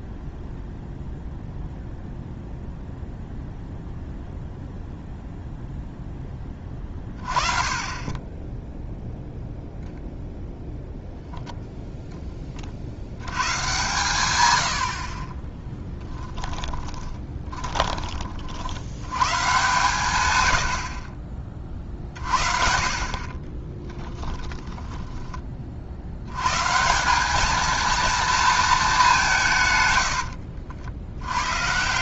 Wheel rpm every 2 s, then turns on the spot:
0, 0, 0, 30, 0, 0, 60, 70, 20, 80, 60, 50, 10, 170, 210, 70.
16-18 24-26 30-32